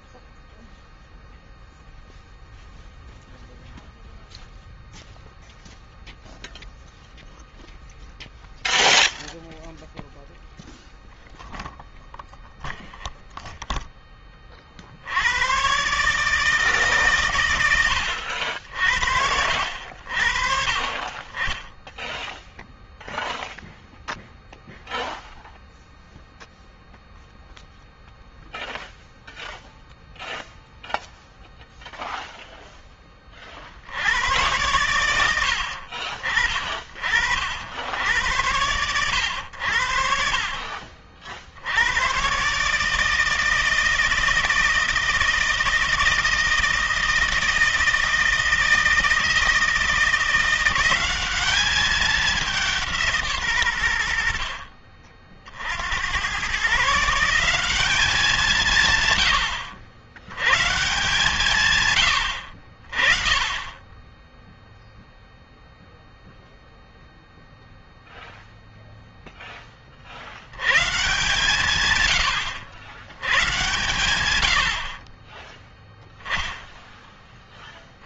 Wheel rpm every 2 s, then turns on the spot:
0, 0, 0, 0, 0, 0, 0, 50, 150, 60, 40, 0, 0, 0, 0, 0, 10, 100, 50, 100, 40, 150, 160, 160, 160, 180, 180, 50, 130, 160, 120, 50, 0, 0, 0, 130, 110, 70, 10.
none